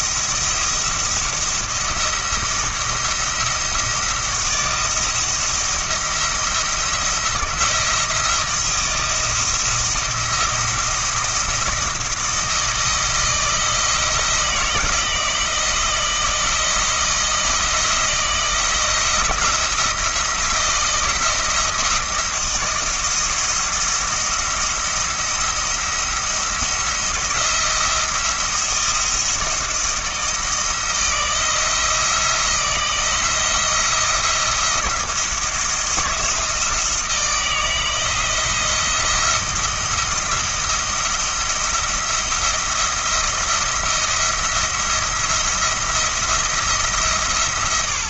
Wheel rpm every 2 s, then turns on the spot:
170, 170, 170, 170, 170, 170, 160, 170, 170, 170, 170, 170, 170, 170, 170, 170, 170, 170, 160, 170, 170, 170, 170, 170.
none